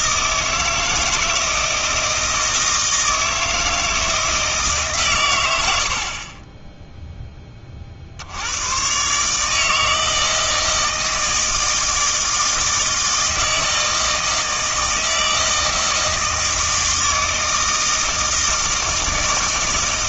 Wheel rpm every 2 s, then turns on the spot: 160, 160, 150, 10, 100, 160, 160, 160, 160, 160.
6-8